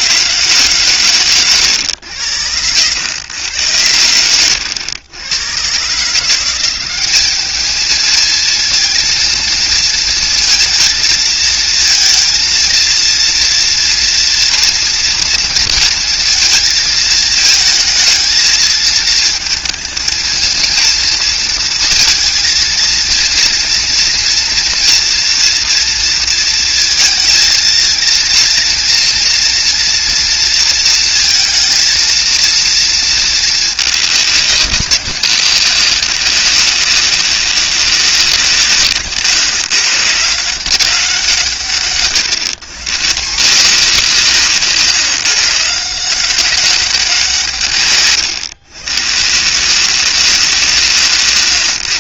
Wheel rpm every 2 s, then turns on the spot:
140, 100, 100, 190, 230, 230, 230, 240, 220, 220, 230, 230, 230, 220, 230, 230, 230, 200, 200, 150, 180, 150, 150, 190, 130, 170.
none